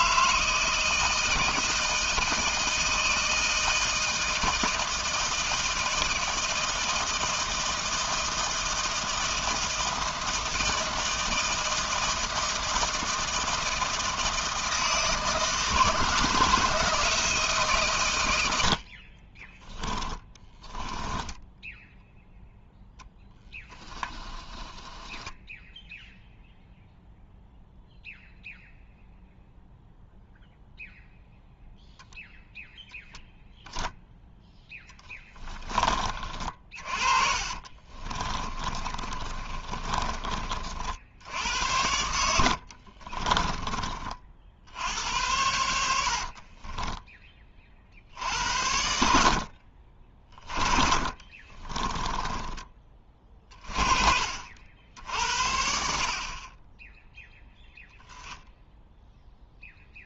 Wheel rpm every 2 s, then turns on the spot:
160, 160, 160, 160, 160, 160, 160, 160, 170, 70, 20, 0, 20, 0, 0, 0, 0, 10, 40, 30, 60, 50, 70, 30, 70, 40, 20, 70, 10, 0.
20-22 24-26 34-36 38-40 42-44 46-48 50-52